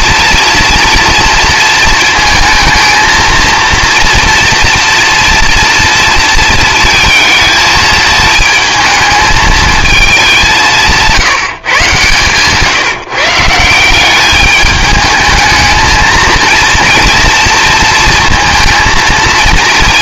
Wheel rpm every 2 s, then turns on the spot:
240, 220, 230, 230, 220, 180, 150, 210, 230, 230.
none